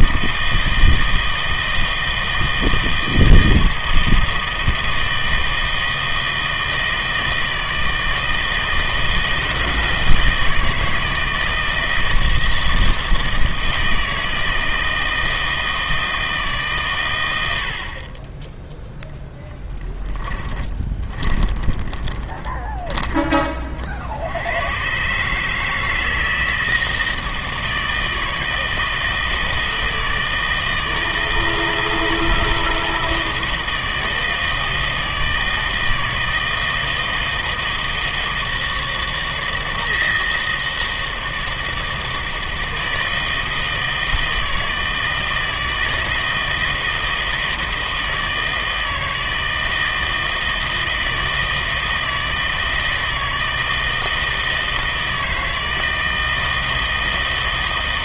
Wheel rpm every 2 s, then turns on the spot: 160, 160, 160, 160, 160, 160, 160, 160, 130, 0, 20, 20, 110, 160, 160, 160, 160, 160, 160, 160, 160, 160, 160, 160, 160, 160, 160, 160, 160.
20-24